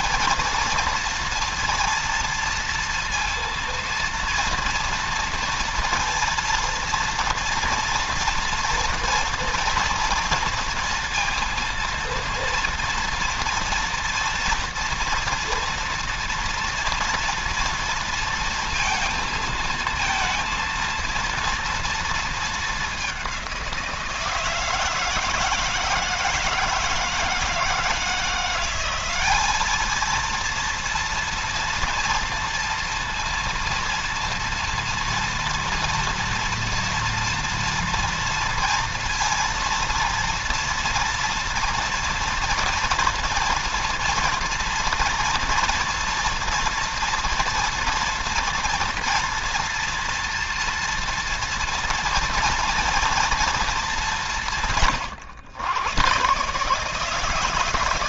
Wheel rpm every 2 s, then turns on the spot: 230, 230, 230, 230, 230, 230, 230, 230, 230, 230, 230, 210, 160, 160, 190, 230, 230, 230, 230, 230, 230, 230, 230, 230, 230, 230, 230, 130, 150.
none